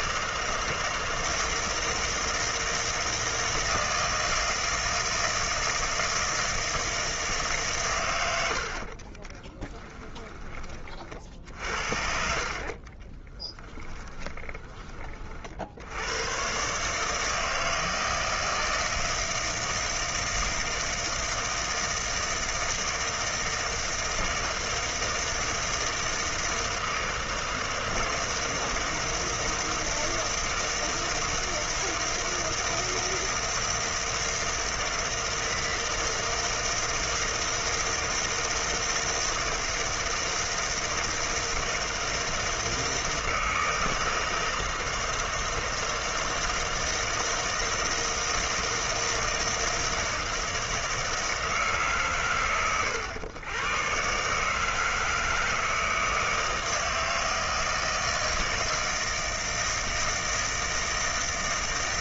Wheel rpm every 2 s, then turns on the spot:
160, 160, 160, 160, 90, 20, 50, 20, 120, 160, 160, 160, 160, 160, 160, 160, 160, 160, 160, 160, 160, 160, 160, 160, 160, 160, 110, 150, 160, 160, 160.
12-16